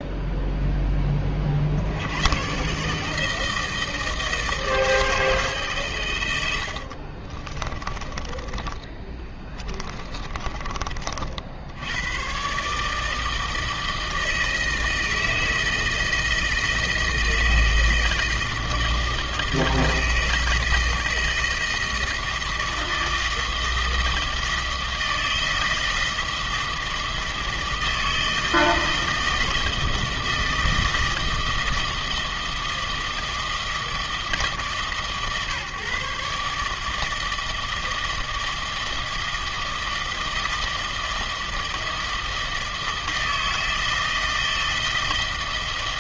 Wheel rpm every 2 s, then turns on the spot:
0, 130, 160, 80, 20, 30, 140, 160, 160, 160, 160, 160, 160, 160, 160, 160, 160, 150, 150, 160, 160, 160, 160.
6-10